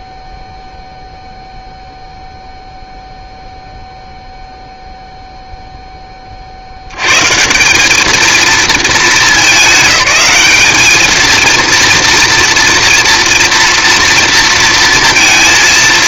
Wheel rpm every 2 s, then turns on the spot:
0, 0, 0, 60, 220, 210, 230, 230.
none